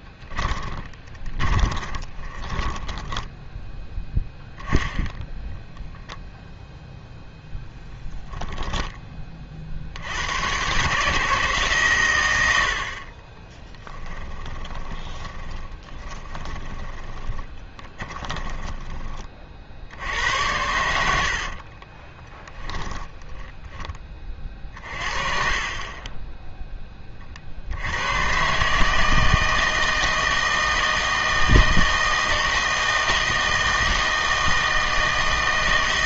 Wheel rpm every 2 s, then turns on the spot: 20, 10, 10, 0, 10, 130, 60, 20, 20, 10, 80, 20, 40, 20, 140, 160, 160, 160.
0-4 14-18 22-24